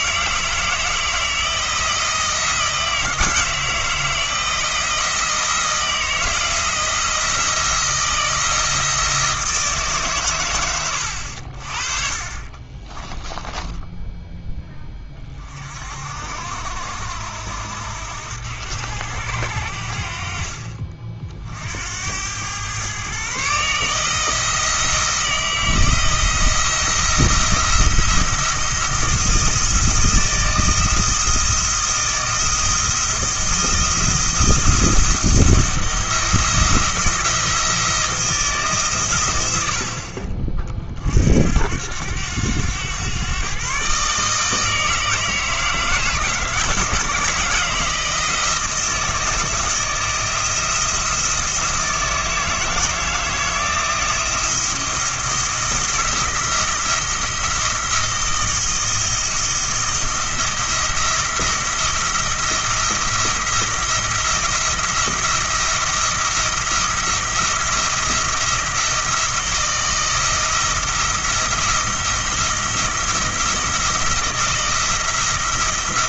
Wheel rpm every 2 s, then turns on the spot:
160, 160, 170, 170, 170, 120, 40, 10, 60, 80, 50, 100, 160, 170, 170, 170, 170, 170, 170, 160, 40, 90, 150, 160, 170, 170, 160, 170, 170, 170, 170, 170, 170, 170, 170, 170, 170, 170.
12-14